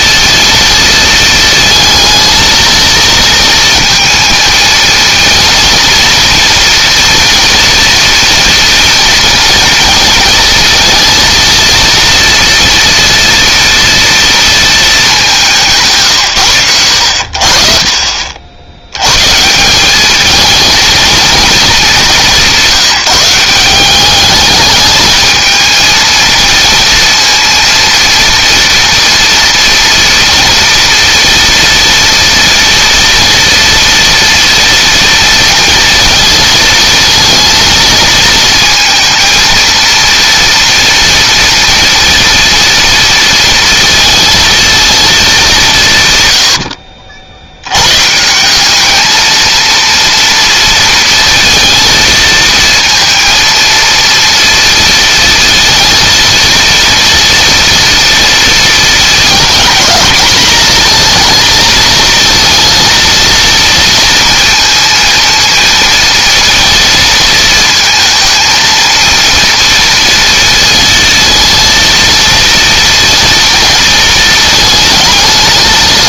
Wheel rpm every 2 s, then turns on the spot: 230, 230, 230, 230, 230, 220, 230, 220, 90, 100, 220, 180, 210, 230, 230, 230, 230, 230, 220, 230, 230, 230, 230, 80, 210, 230, 230, 230, 230, 230, 230, 230, 230, 230, 230, 230, 230, 210.
none